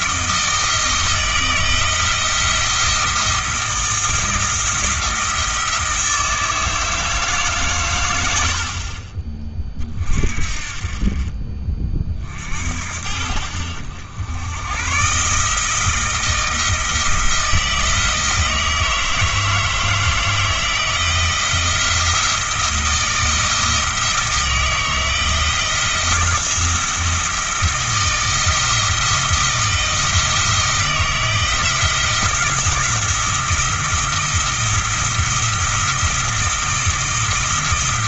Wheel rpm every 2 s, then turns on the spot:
160, 170, 170, 160, 40, 40, 60, 110, 160, 160, 170, 160, 160, 170, 170, 160, 170, 170, 170.
none